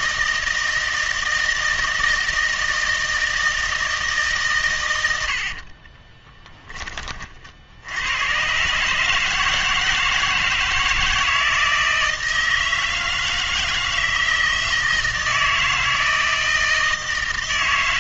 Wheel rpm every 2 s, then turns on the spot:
160, 160, 120, 30, 140, 160, 160, 160, 160.
6-8